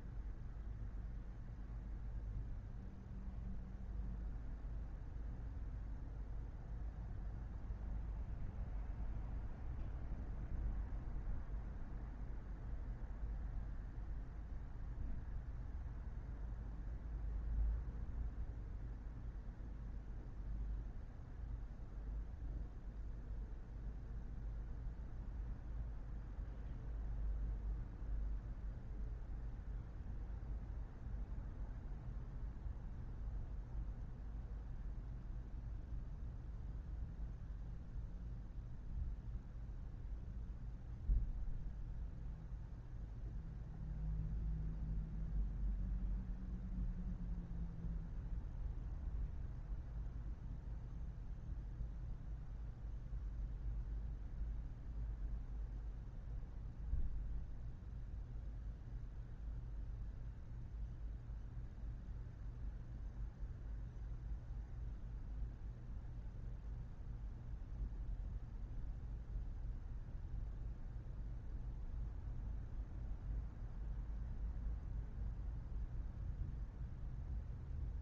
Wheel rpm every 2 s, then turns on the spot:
0, 0, 0, 0, 0, 0, 0, 0, 0, 0, 0, 0, 0, 0, 0, 0, 0, 0, 0, 0, 0, 0, 0, 0, 0, 0, 0, 0, 0, 0, 0, 0, 0, 0, 0, 0, 0, 0, 0.
none